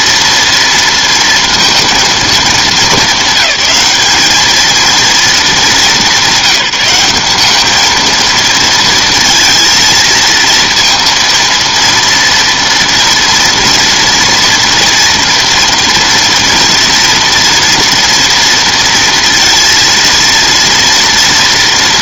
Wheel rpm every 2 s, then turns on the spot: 230, 220, 220, 180, 230, 230, 240, 240, 240, 230, 230.
none